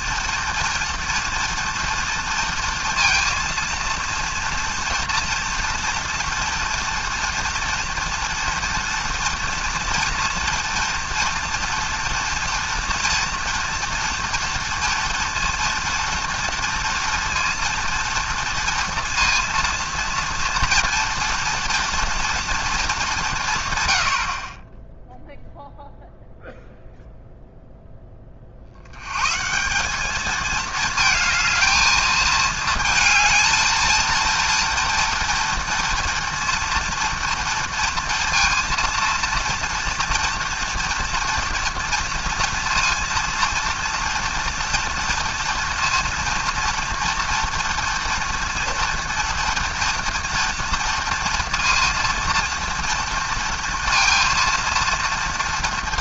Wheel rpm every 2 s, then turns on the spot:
230, 230, 230, 230, 230, 230, 240, 230, 230, 230, 230, 230, 30, 0, 60, 220, 220, 230, 230, 230, 230, 230, 240, 230, 230, 230, 230, 230.
none